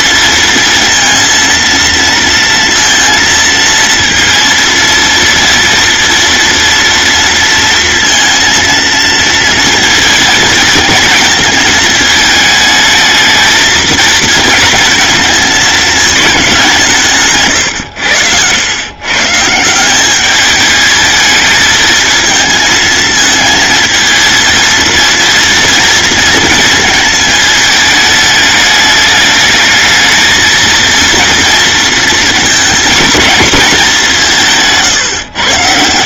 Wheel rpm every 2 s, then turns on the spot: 230, 230, 230, 230, 230, 220, 220, 230, 180, 110, 210, 220, 220, 220, 210, 230, 220, 160.
none